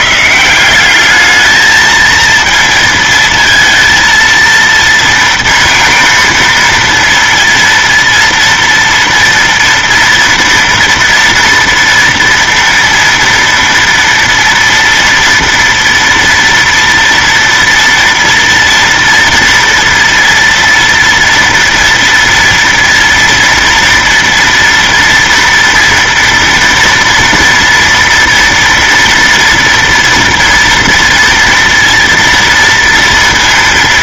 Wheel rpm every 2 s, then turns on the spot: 170, 230, 230, 230, 230, 230, 230, 230, 230, 230, 230, 230, 230, 230, 230, 240, 230.
none